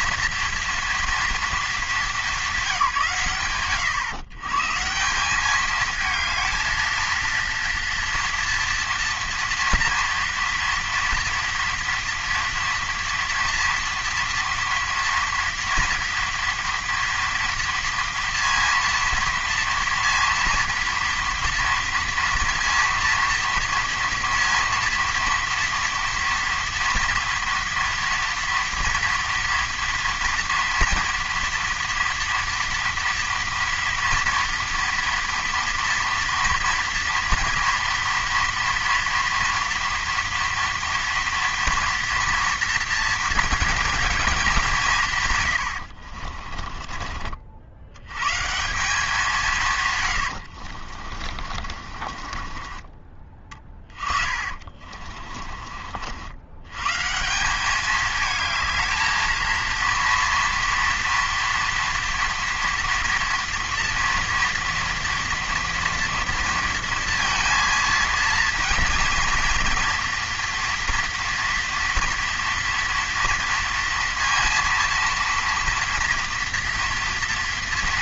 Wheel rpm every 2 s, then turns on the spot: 240, 180, 140, 220, 240, 230, 240, 230, 230, 230, 230, 230, 240, 230, 230, 230, 230, 230, 230, 230, 240, 230, 190, 30, 170, 60, 30, 30, 110, 220, 230, 230, 230, 230, 230, 240, 230, 230, 230.
46-48 50-56